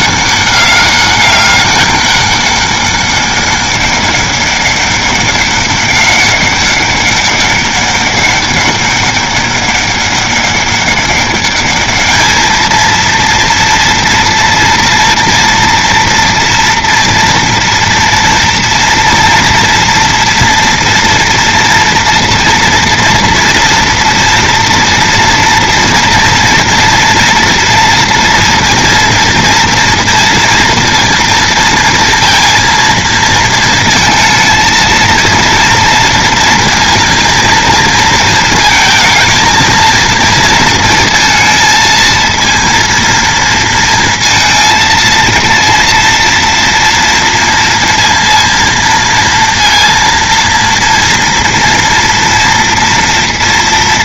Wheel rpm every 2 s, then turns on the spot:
200, 200, 200, 200, 200, 200, 220, 230, 240, 240, 240, 230, 230, 230, 230, 230, 230, 220, 230, 220, 230, 230, 230, 230, 230, 230, 230.
none